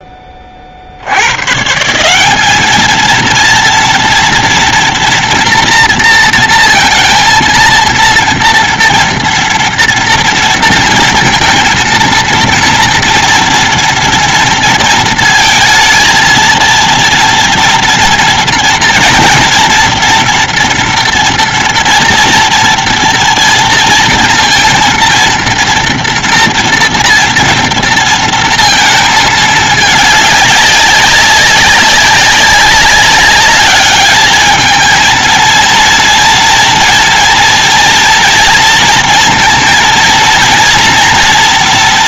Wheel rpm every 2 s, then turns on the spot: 10, 190, 230, 230, 230, 230, 230, 230, 230, 230, 230, 230, 230, 230, 230, 200, 200, 210, 230, 230, 230.
none